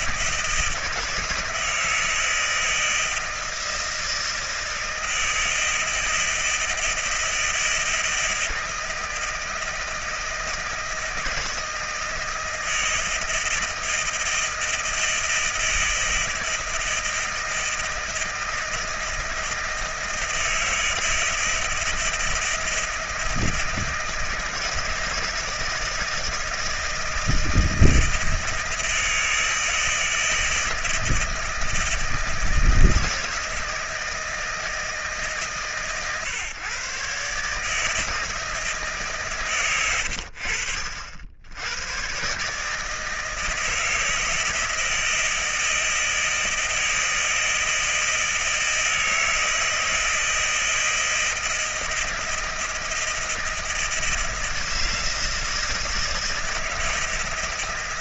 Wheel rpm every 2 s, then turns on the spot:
160, 160, 160, 160, 160, 160, 160, 160, 160, 160, 160, 160, 160, 160, 160, 160, 160, 160, 130, 160, 90, 130, 160, 160, 160, 160, 160, 160, 160.
none